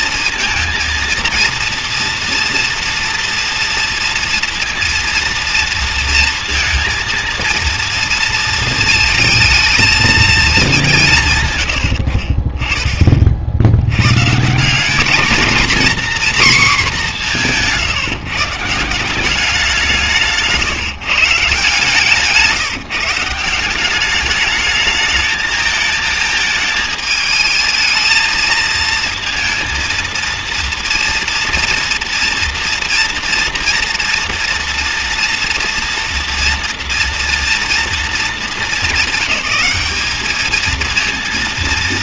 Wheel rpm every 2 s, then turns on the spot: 220, 230, 230, 230, 220, 160, 40, 220, 200, 180, 150, 160, 220, 220, 230, 230, 230, 230, 230, 200, 230.
none